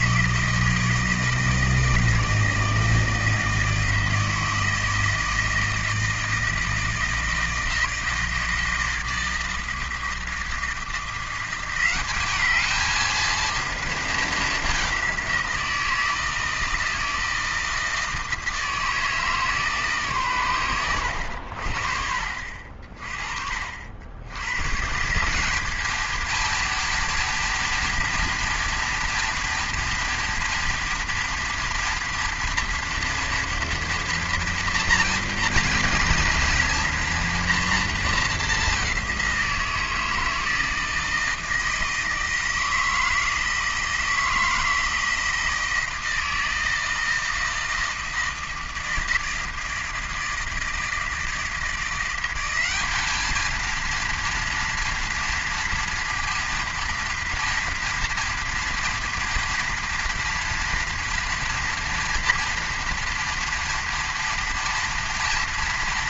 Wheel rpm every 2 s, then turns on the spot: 160, 160, 160, 160, 160, 160, 210, 200, 160, 160, 110, 50, 130, 230, 230, 230, 230, 230, 240, 200, 160, 160, 160, 160, 160, 160, 200, 230, 230, 240, 230, 240, 230.
none